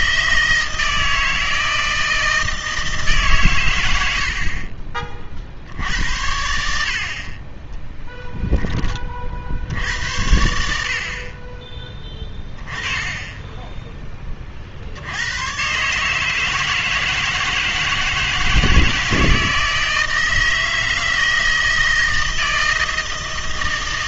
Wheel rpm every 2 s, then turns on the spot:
160, 160, 40, 60, 10, 70, 20, 50, 150, 160, 160, 160.
none